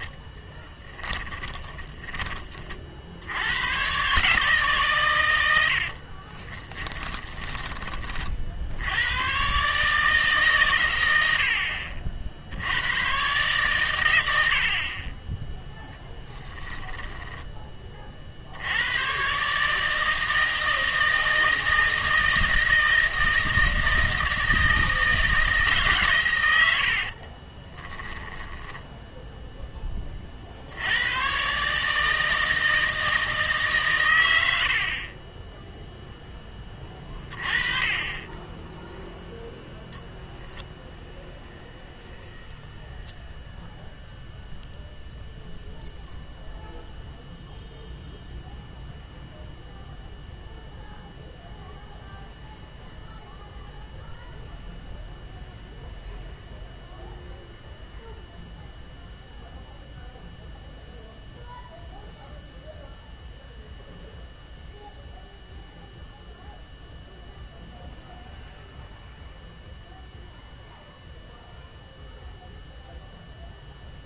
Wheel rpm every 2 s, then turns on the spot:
20, 50, 140, 20, 70, 110, 100, 40, 10, 90, 160, 170, 160, 80, 10, 80, 160, 60, 20, 10, 0, 0, 0, 0, 0, 0, 0, 0, 0, 0, 0, 0, 0, 0, 0, 0, 0.
0-2 6-8 16-18 26-30 38-40